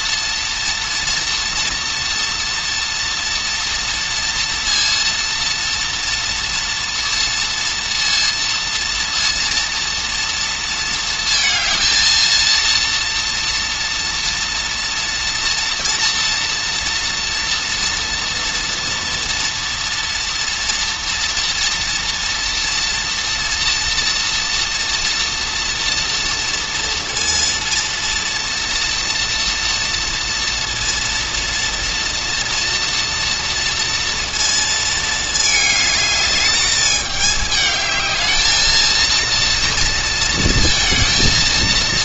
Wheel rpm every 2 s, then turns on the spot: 230, 230, 230, 230, 230, 230, 230, 230, 230, 230, 230, 230, 240, 230, 230, 230, 240, 220, 210, 220, 230.
none